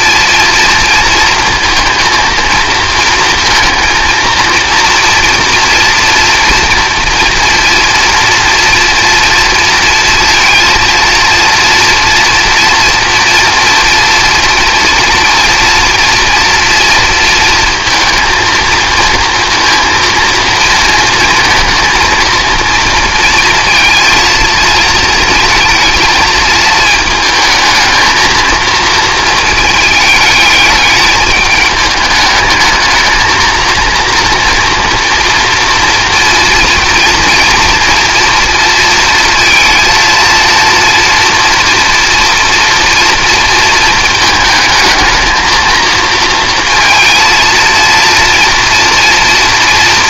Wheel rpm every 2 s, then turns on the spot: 230, 230, 230, 230, 230, 230, 230, 230, 230, 230, 220, 230, 220, 220, 230, 210, 220, 240, 240, 230, 230, 230, 220, 230, 230.
none